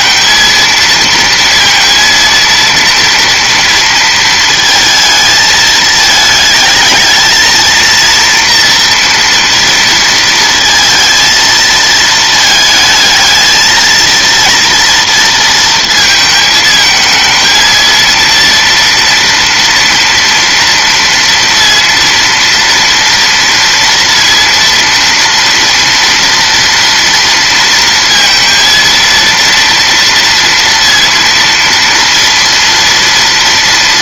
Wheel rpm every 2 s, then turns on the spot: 230, 230, 220, 220, 240, 230, 220, 230, 220, 230, 230, 230, 230, 230, 230, 230, 230.
none